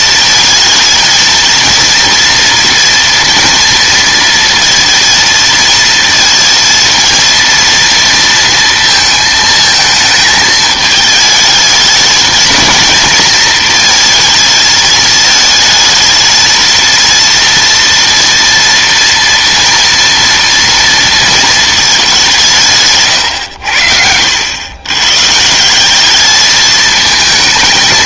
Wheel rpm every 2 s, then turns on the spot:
230, 230, 230, 230, 230, 220, 230, 220, 230, 240, 230, 140, 120, 220.
none